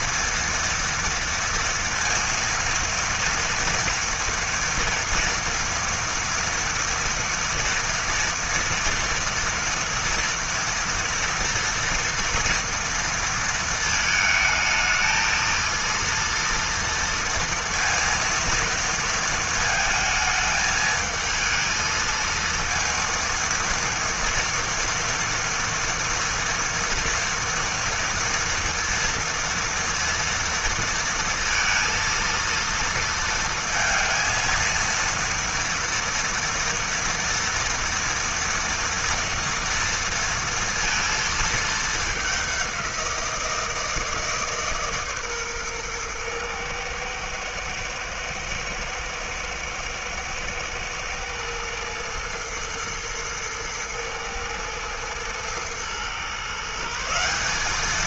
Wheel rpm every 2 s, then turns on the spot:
240, 230, 230, 230, 230, 230, 230, 220, 230, 220, 220, 230, 230, 230, 230, 230, 230, 230, 230, 230, 220, 180, 140, 120, 110, 110, 110, 110, 170.
none